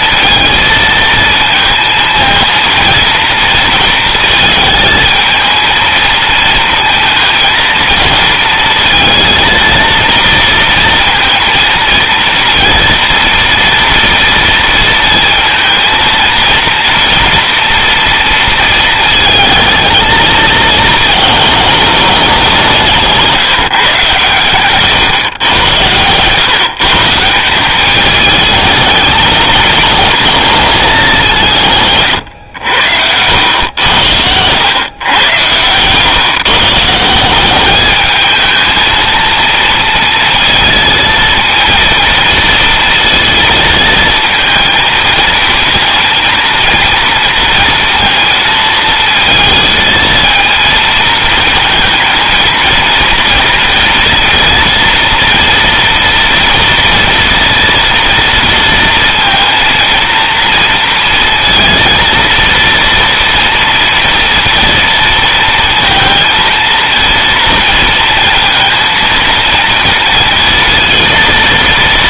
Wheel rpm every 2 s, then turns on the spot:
230, 230, 220, 220, 230, 230, 230, 230, 230, 230, 220, 170, 130, 150, 220, 210, 80, 110, 160, 230, 230, 230, 230, 230, 230, 230, 230, 230, 230, 230, 230, 230, 230, 230, 230, 230.
22-24